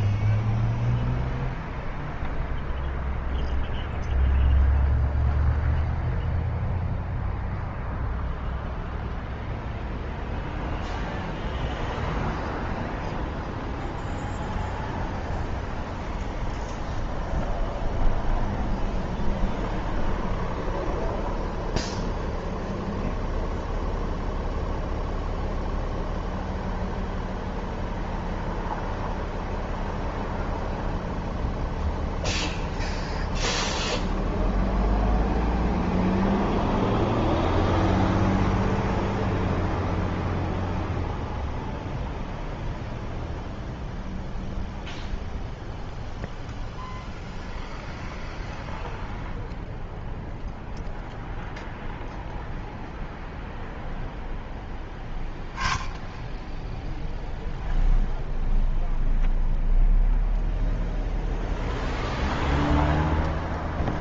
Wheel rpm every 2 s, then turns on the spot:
0, 0, 0, 0, 0, 0, 0, 0, 0, 0, 0, 0, 0, 0, 0, 0, 0, 0, 0, 0, 0, 0, 0, 0, 0, 0, 0, 0, 0, 0, 0, 0.
none